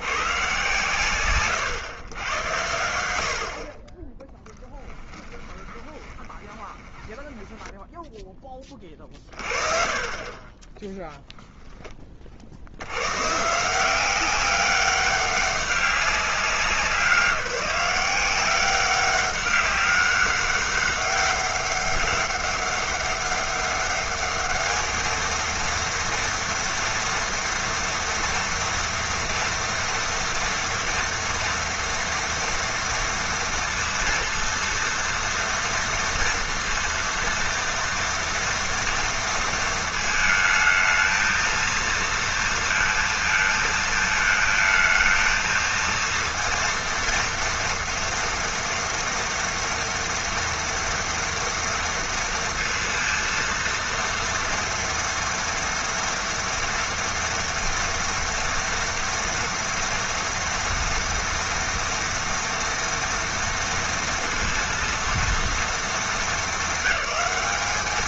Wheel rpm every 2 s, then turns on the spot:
120, 90, 10, 20, 20, 20, 70, 190, 190, 180, 200, 200, 210, 240, 230, 230, 240, 230, 230, 230, 220, 230, 220, 230, 230, 230, 230, 230, 240, 230, 230, 240, 230, 210.
4-8